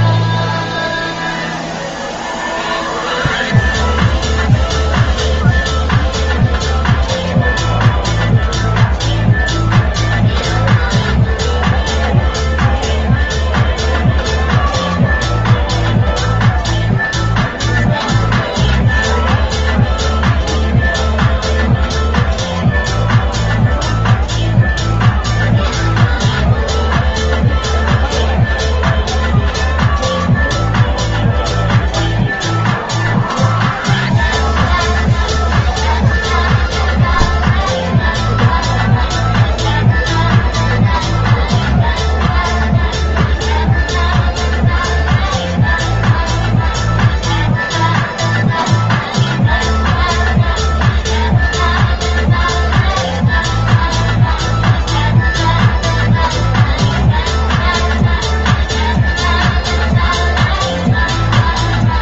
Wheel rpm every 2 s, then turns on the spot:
0, 0, 0, 0, 0, 0, 0, 0, 0, 0, 0, 0, 0, 0, 0, 0, 0, 0, 0, 0, 0, 0, 0, 0, 0, 0, 0, 0, 0, 0, 0.
none